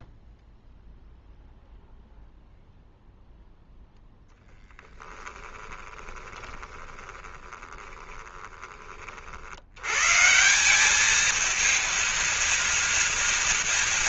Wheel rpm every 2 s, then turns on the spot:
0, 0, 10, 20, 30, 190, 230.
4-8